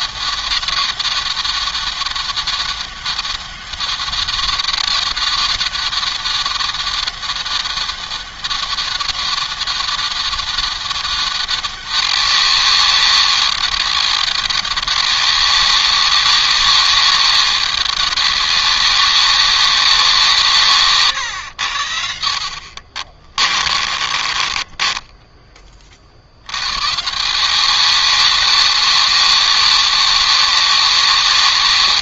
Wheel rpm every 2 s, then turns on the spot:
200, 190, 190, 200, 190, 200, 200, 200, 200, 200, 150, 60, 20, 140, 200, 190.
22-26